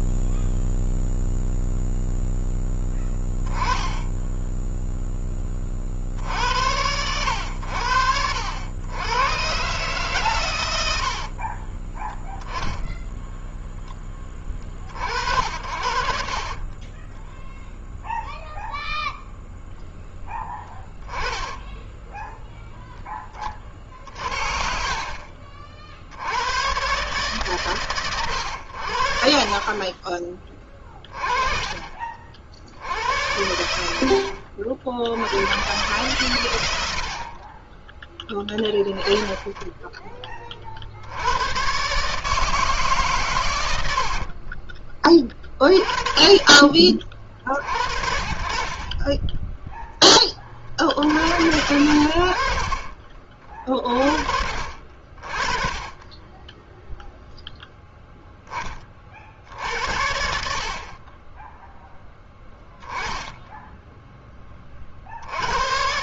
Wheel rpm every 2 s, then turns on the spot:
0, 10, 10, 80, 110, 80, 10, 50, 20, 0, 10, 20, 50, 120, 80, 30, 80, 70, 80, 10, 60, 140, 20, 40, 20, 70, 40, 40, 0, 40, 30, 10, 50.
10-14 20-22 36-38 48-50